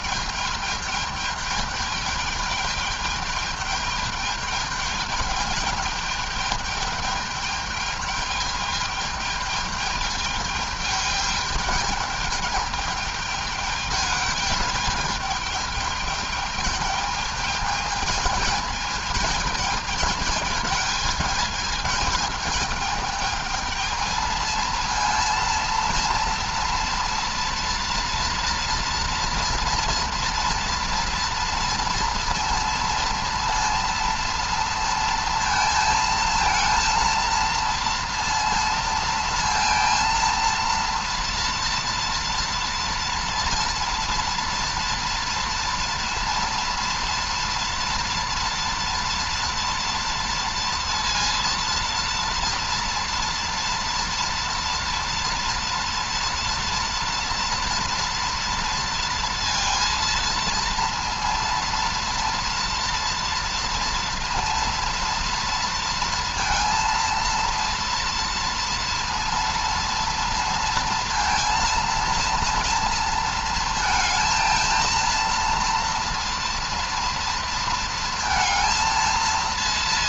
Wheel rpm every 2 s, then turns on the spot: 210, 210, 210, 210, 210, 210, 210, 210, 220, 220, 220, 210, 230, 230, 230, 240, 230, 230, 230, 230, 230, 230, 230, 230, 230, 230, 240, 230, 230, 230, 230, 230, 230, 230, 230, 230, 230, 230, 230, 220.
none